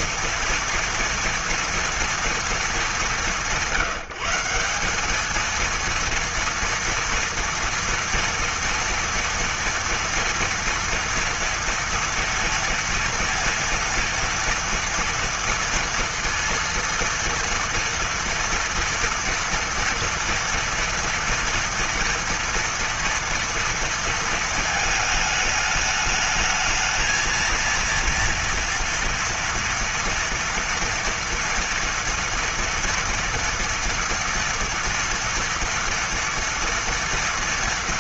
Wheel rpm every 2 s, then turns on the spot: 230, 210, 180, 230, 230, 230, 230, 230, 230, 230, 230, 230, 220, 220, 230, 240, 230, 230, 230.
none